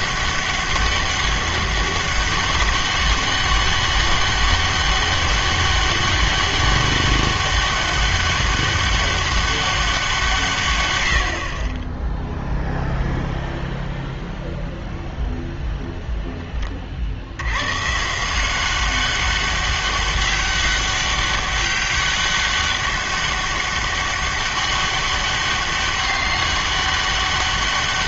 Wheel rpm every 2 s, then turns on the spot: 200, 200, 200, 200, 200, 140, 0, 0, 30, 180, 200, 200, 200, 200.
none